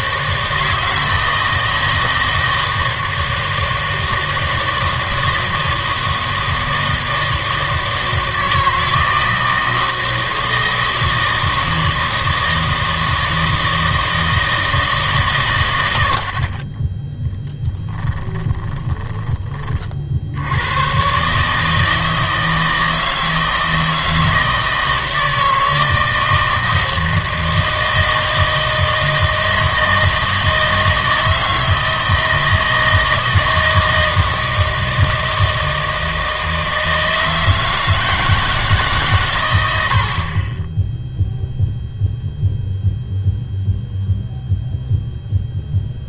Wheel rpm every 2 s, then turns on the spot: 160, 160, 160, 160, 160, 160, 160, 160, 40, 20, 110, 160, 160, 160, 160, 160, 160, 160, 160, 150, 20, 0, 0.
18-20